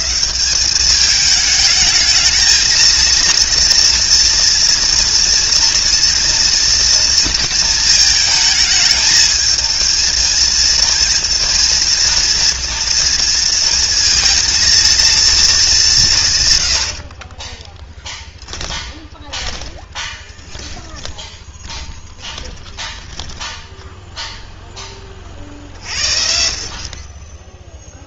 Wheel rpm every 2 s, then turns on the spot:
190, 230, 230, 240, 220, 230, 230, 230, 100, 10, 20, 10, 0, 50.
18-24